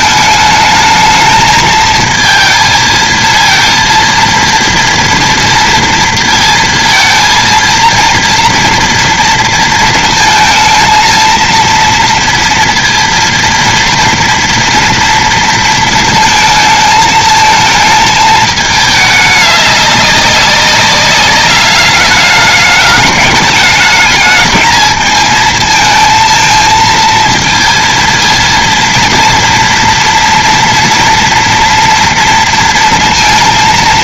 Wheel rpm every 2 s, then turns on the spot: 220, 230, 240, 230, 230, 230, 230, 230, 220, 210, 200, 210, 220, 230, 230, 230, 230.
none